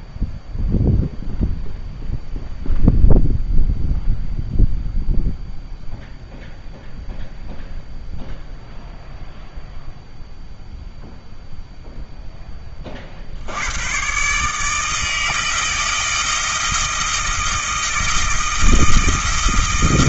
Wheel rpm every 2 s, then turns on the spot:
0, 0, 0, 0, 0, 0, 20, 150, 160, 160.
none